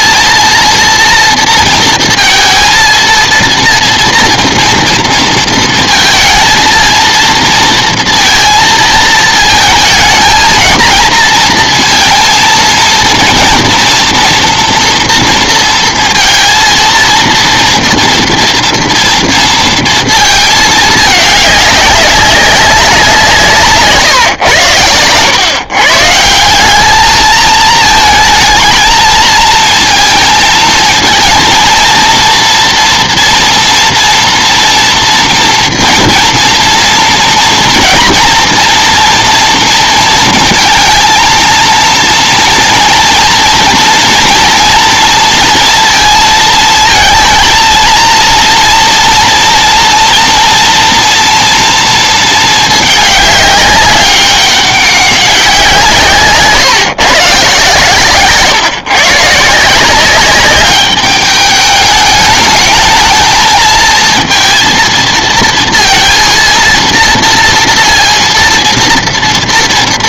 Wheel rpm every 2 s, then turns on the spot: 230, 230, 230, 230, 230, 220, 230, 230, 230, 230, 220, 190, 110, 190, 220, 220, 230, 240, 230, 230, 230, 230, 230, 220, 230, 230, 210, 190, 140, 140, 200, 210, 220, 230, 230.
none